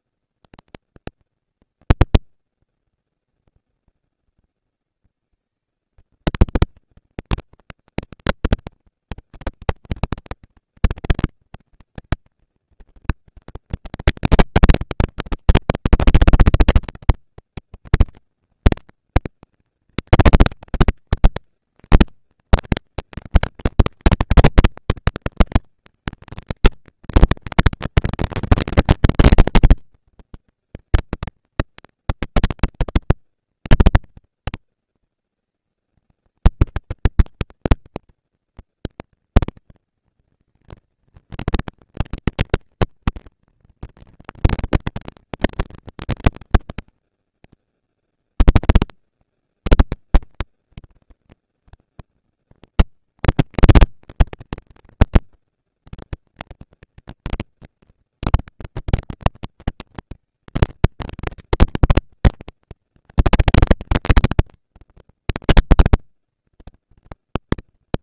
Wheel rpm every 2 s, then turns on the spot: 230, 230, 220, 220, 230, 230, 220, 190, 200, 220, 220, 230, 230, 230, 230, 230, 230, 230, 220, 230, 230, 230, 230, 220, 210, 190, 210, 220, 230, 230, 230, 230, 230, 230.
none